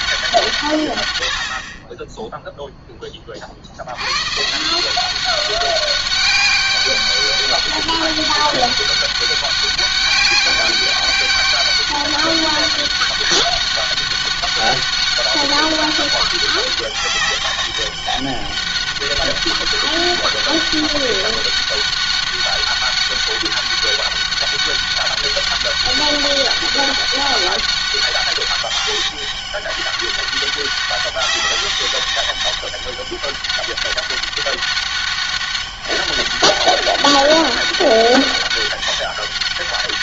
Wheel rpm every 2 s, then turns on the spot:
160, 10, 140, 200, 200, 200, 200, 200, 200, 200, 200, 200, 200, 200, 200, 200, 200, 200, 200, 200.
none